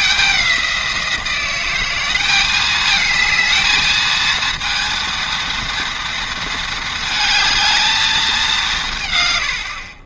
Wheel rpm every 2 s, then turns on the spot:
180, 210, 230, 220, 180.
none